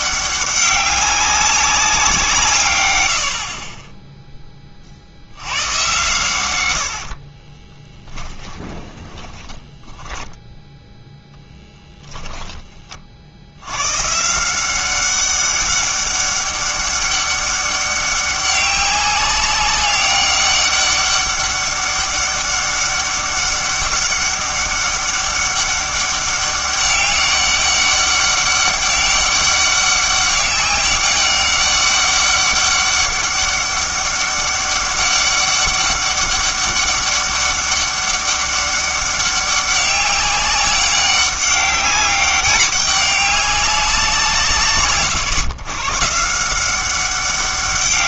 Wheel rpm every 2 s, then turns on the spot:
200, 130, 30, 100, 10, 0, 20, 180, 200, 200, 200, 200, 200, 200, 200, 200, 200, 200, 200, 200, 200, 200, 150, 180.
8-10